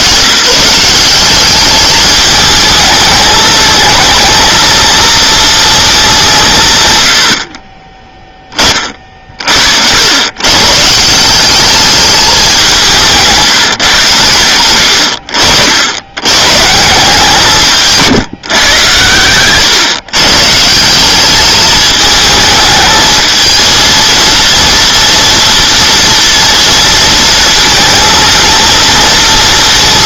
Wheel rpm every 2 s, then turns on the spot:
170, 210, 230, 140, 30, 140, 190, 80, 140, 130, 170, 220, 240, 230, 230.
none